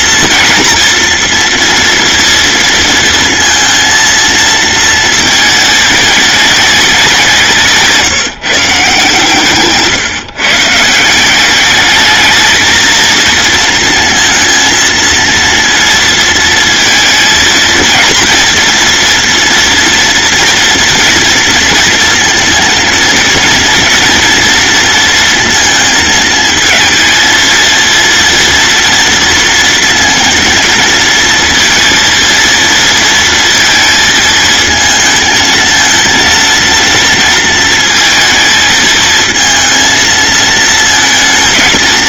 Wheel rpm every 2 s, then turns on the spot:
240, 230, 220, 200, 150, 160, 230, 230, 220, 230, 230, 230, 230, 220, 230, 220, 230, 220, 230, 220, 220.
none